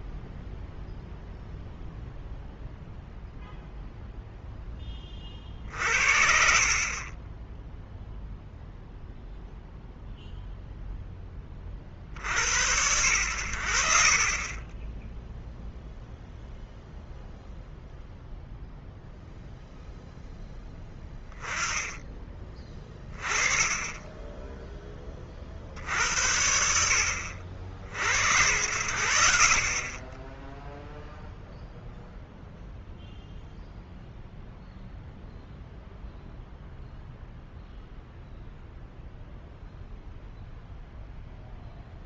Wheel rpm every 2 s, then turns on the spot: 0, 0, 20, 40, 0, 0, 90, 10, 0, 0, 10, 20, 20, 80, 80, 0, 0, 0, 0, 0, 0.
none